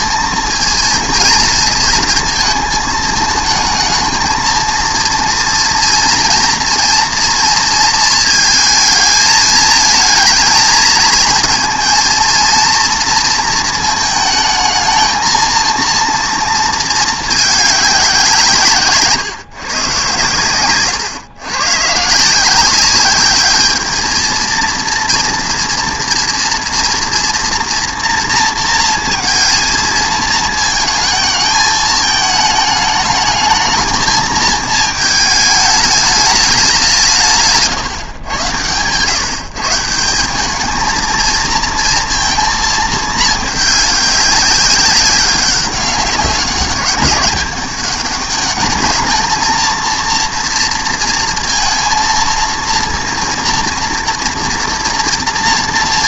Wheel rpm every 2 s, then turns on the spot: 230, 220, 230, 230, 220, 220, 230, 220, 220, 150, 120, 190, 230, 240, 230, 220, 210, 220, 190, 120, 220, 230, 200, 200, 210, 230, 230, 230.
none